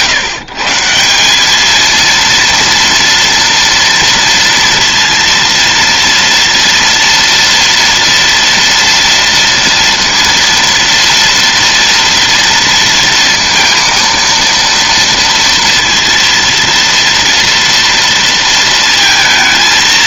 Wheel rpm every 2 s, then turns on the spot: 150, 230, 230, 230, 230, 230, 230, 230, 230, 230.
none